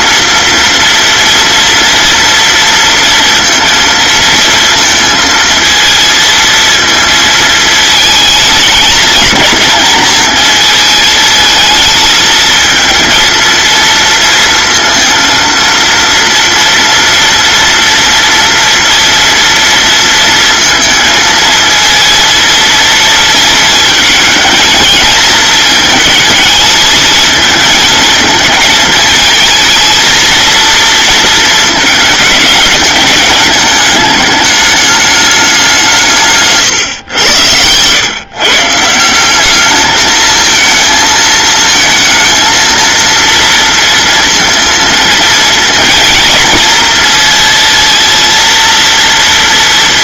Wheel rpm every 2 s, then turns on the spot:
230, 230, 230, 230, 220, 220, 230, 230, 230, 230, 230, 230, 230, 220, 220, 230, 210, 210, 140, 160, 220, 230, 230, 230, 230.
none